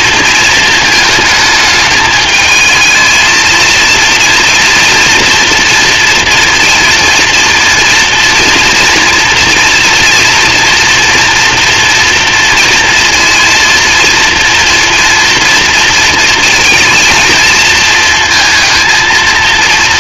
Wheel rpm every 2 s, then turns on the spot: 220, 220, 230, 230, 230, 230, 230, 230, 220, 230.
none